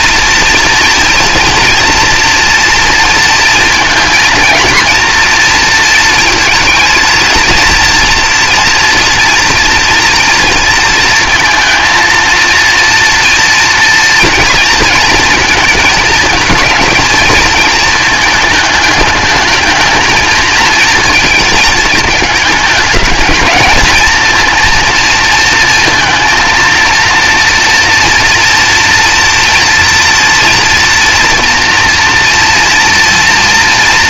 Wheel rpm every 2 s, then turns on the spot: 230, 230, 230, 230, 230, 230, 230, 230, 220, 220, 230, 210, 230, 230, 230, 230, 240.
none